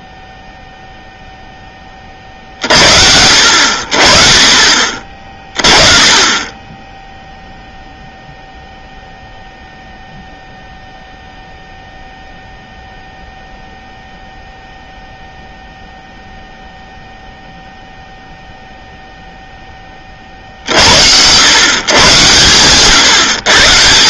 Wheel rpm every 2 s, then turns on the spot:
0, 60, 40, 10, 0, 0, 0, 0, 0, 0, 50, 120.
22-24